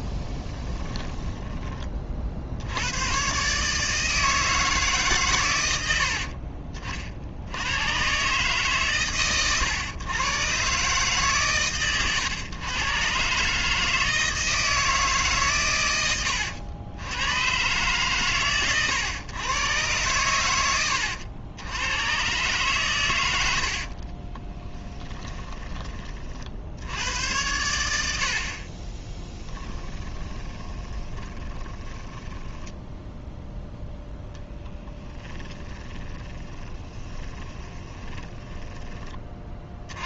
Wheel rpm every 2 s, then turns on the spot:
10, 100, 150, 50, 130, 130, 120, 160, 90, 120, 100, 120, 20, 80, 30, 20, 10, 10, 30, 10.
0-2 24-26 28-32 34-38